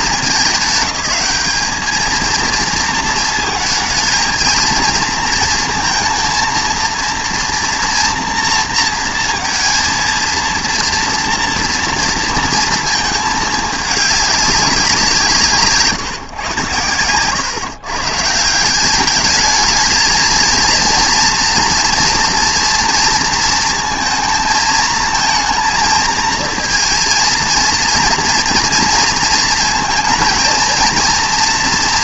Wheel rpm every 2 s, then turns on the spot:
200, 230, 220, 230, 230, 230, 230, 190, 110, 190, 230, 230, 220, 230, 230, 230.
none